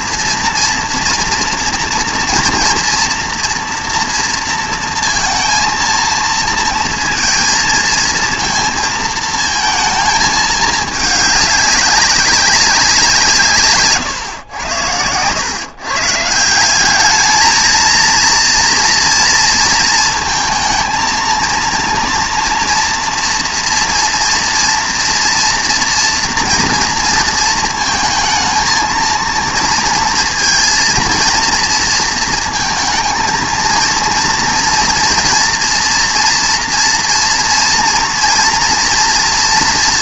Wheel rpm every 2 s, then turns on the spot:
230, 230, 230, 230, 220, 220, 190, 100, 190, 230, 230, 240, 230, 230, 230, 230, 230, 230, 240, 230.
none